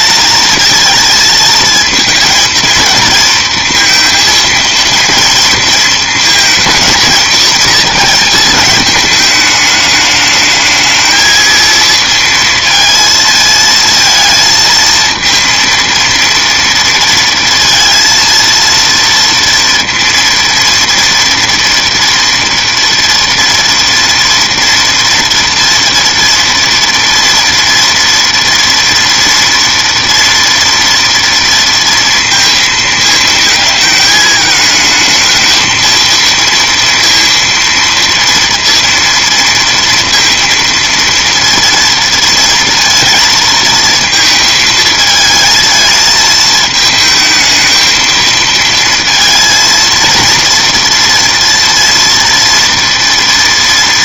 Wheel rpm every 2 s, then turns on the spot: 230, 220, 230, 230, 210, 220, 220, 220, 230, 230, 230, 230, 230, 230, 230, 230, 220, 220, 230, 230, 230, 230, 220, 220, 230, 230, 230.
none